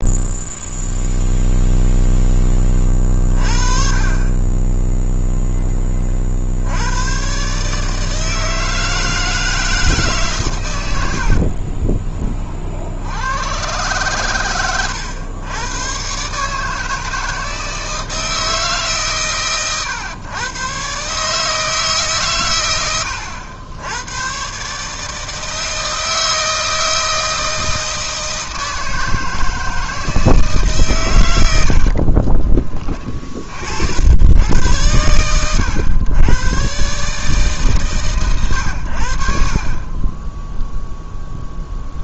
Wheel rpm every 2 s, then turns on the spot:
0, 40, 0, 120, 160, 80, 80, 110, 160, 150, 140, 90, 150, 160, 160, 130, 30, 110, 140, 90, 0.
10-12